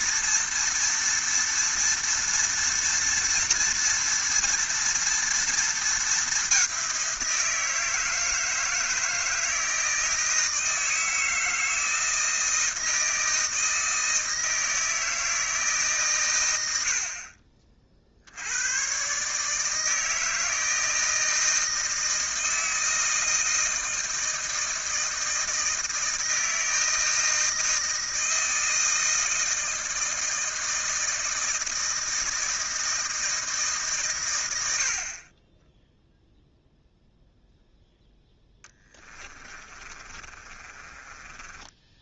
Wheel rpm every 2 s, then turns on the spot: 230, 230, 230, 190, 160, 160, 160, 160, 90, 100, 160, 160, 160, 160, 160, 160, 160, 80, 0, 20, 30.
38-42